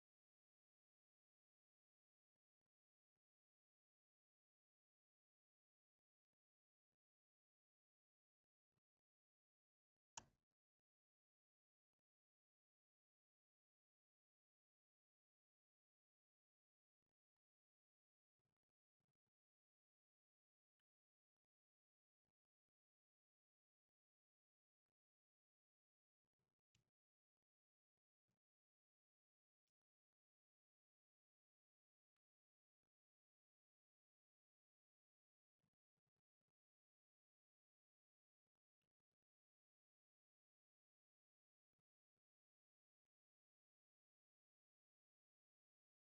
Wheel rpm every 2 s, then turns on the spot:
0, 0, 0, 0, 0, 0, 0, 0, 0, 0, 0, 0, 0, 0, 0, 0, 0, 0, 0, 0, 0, 0, 0.
none